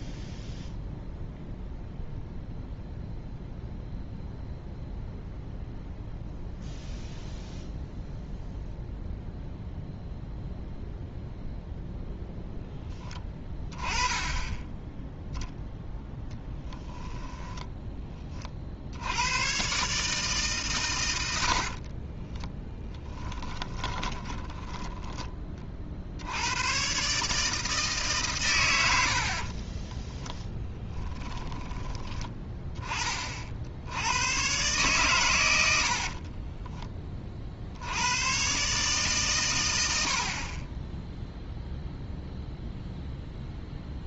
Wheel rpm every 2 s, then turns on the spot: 0, 0, 0, 0, 0, 0, 0, 10, 10, 30, 140, 10, 10, 90, 130, 10, 20, 120, 30, 130, 40, 0.
22-26 30-32 36-38